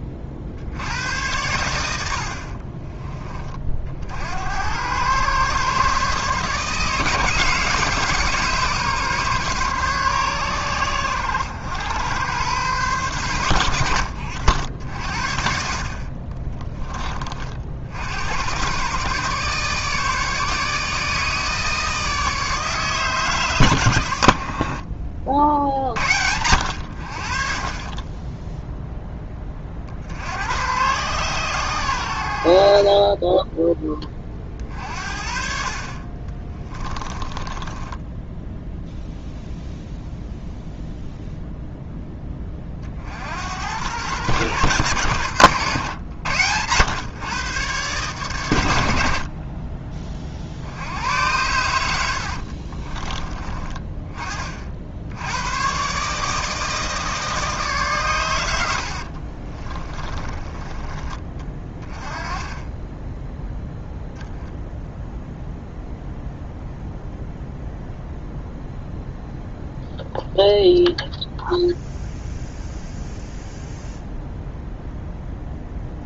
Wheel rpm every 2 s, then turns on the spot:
90, 20, 110, 150, 150, 100, 120, 60, 20, 120, 150, 140, 50, 70, 0, 110, 40, 40, 20, 0, 0, 50, 110, 110, 70, 80, 40, 60, 160, 70, 20, 10, 0, 0, 0, 0, 0, 0.
36-38 52-54 58-60